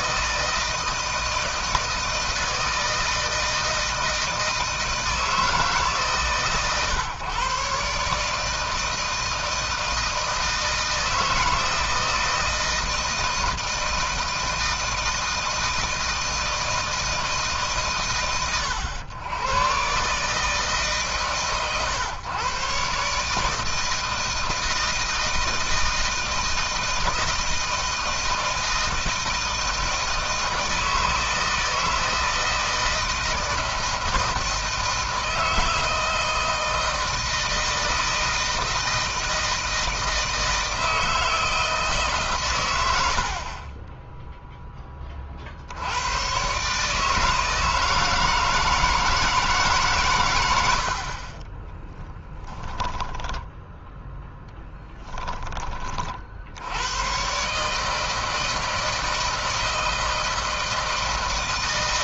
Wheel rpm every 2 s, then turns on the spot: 160, 160, 160, 140, 150, 160, 160, 160, 160, 100, 140, 130, 160, 160, 160, 160, 160, 160, 160, 160, 160, 120, 10, 130, 160, 100, 10, 10, 80, 160, 160.
52-56